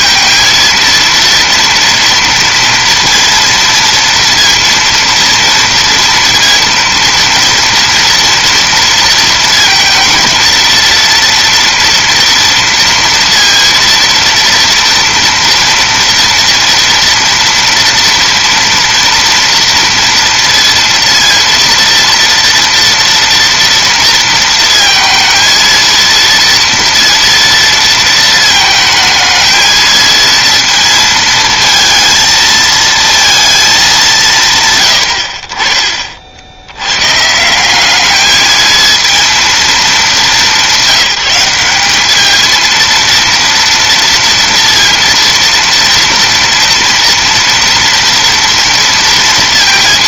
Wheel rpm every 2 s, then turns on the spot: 230, 230, 230, 230, 230, 230, 230, 230, 230, 230, 230, 230, 230, 230, 220, 230, 230, 130, 90, 220, 200, 230, 230, 230, 230.
none